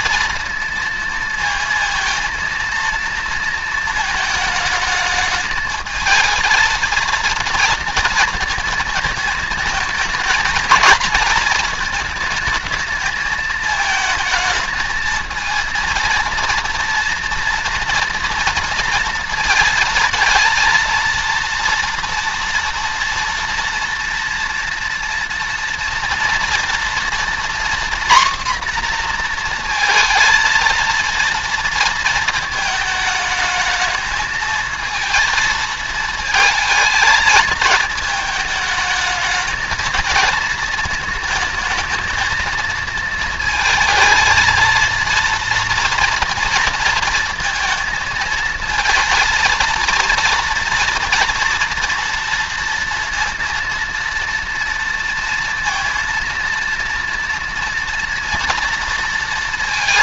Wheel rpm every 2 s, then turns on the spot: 230, 230, 220, 230, 220, 230, 220, 220, 230, 230, 230, 230, 230, 230, 240, 230, 220, 220, 220, 220, 220, 230, 230, 230, 230, 230, 230, 230, 230, 230.
none